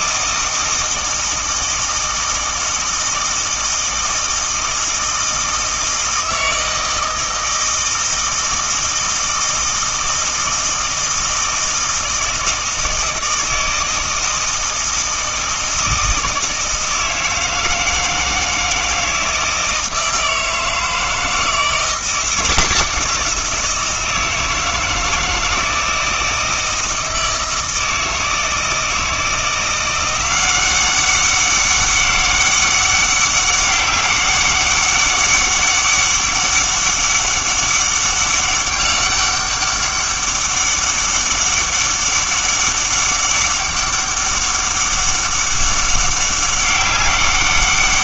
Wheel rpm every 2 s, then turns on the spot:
160, 160, 160, 160, 160, 160, 160, 160, 160, 160, 160, 180, 160, 160, 160, 190, 200, 200, 200, 200, 200, 200, 200, 200.
none